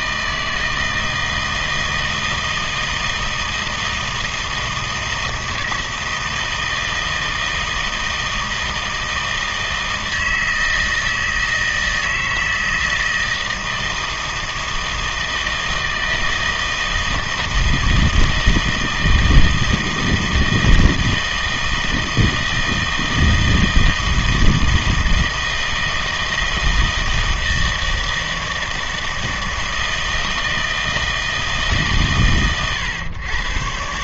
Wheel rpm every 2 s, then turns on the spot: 160, 160, 160, 160, 160, 160, 160, 160, 160, 160, 160, 160, 160, 160, 160, 160, 110.
none